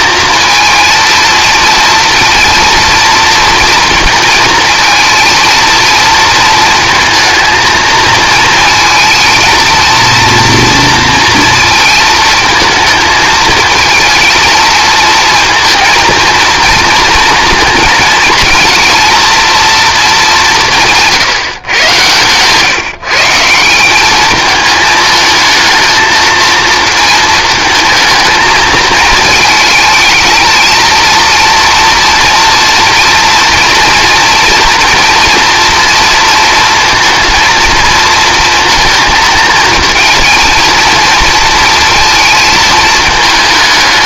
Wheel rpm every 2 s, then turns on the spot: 230, 230, 230, 220, 220, 230, 220, 220, 220, 220, 170, 140, 220, 230, 220, 230, 230, 240, 230, 230, 230, 220.
none